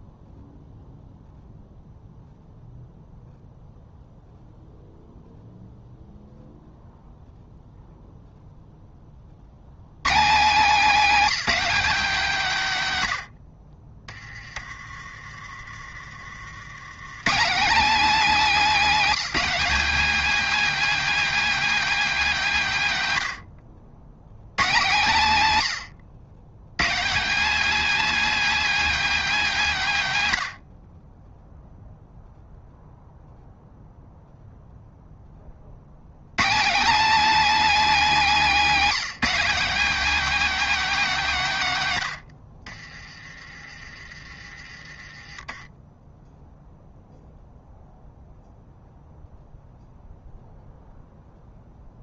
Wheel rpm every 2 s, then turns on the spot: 0, 0, 0, 0, 0, 190, 170, 30, 90, 250, 280, 200, 130, 140, 280, 90, 0, 0, 210, 240, 270, 60, 30, 0, 0, 0.
none